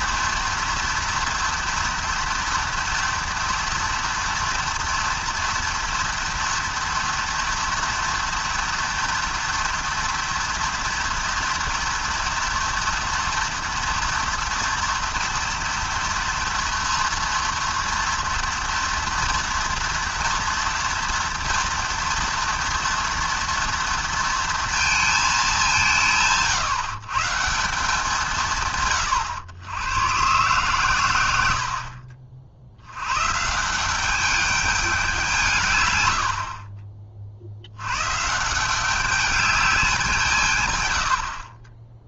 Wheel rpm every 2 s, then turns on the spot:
240, 230, 230, 230, 230, 230, 230, 230, 230, 230, 230, 230, 230, 150, 140, 130, 70, 200, 40, 190, 120.
none